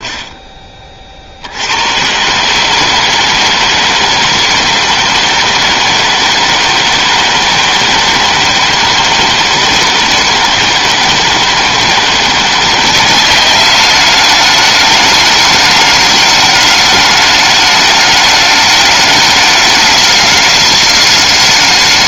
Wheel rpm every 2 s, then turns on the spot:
30, 150, 160, 160, 160, 160, 180, 210, 210, 210, 210.
none